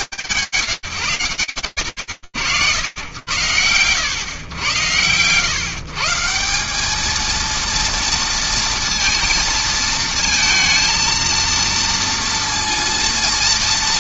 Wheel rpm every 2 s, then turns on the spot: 80, 110, 170, 230, 230, 230, 230.
none